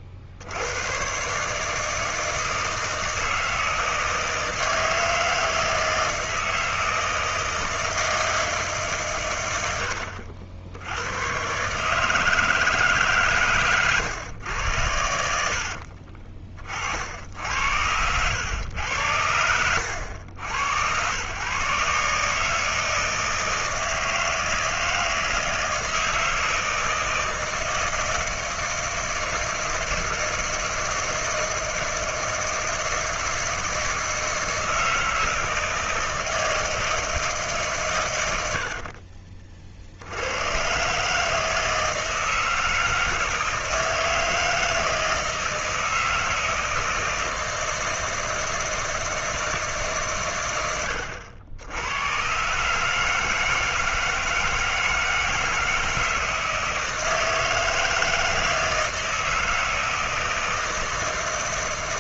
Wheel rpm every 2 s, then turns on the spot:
70, 160, 160, 160, 160, 70, 160, 100, 50, 100, 100, 150, 160, 160, 160, 160, 160, 160, 160, 90, 100, 160, 160, 160, 160, 110, 130, 160, 160, 160, 160.
none